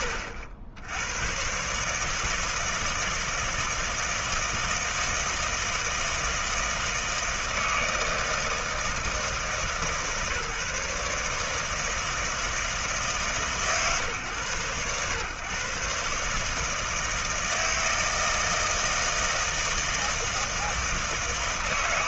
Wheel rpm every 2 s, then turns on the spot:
80, 160, 160, 160, 160, 150, 160, 110, 160, 160, 160.
none